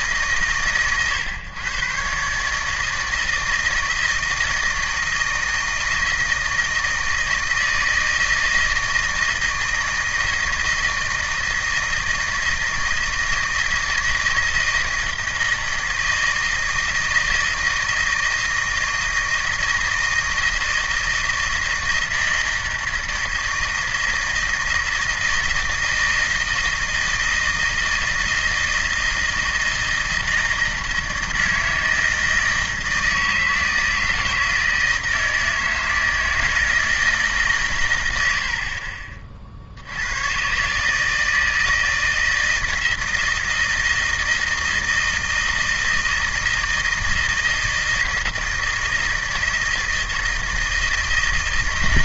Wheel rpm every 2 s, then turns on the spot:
120, 160, 160, 160, 160, 160, 160, 160, 160, 160, 160, 160, 160, 160, 160, 160, 160, 160, 160, 40, 140, 160, 160, 160, 160, 160.
none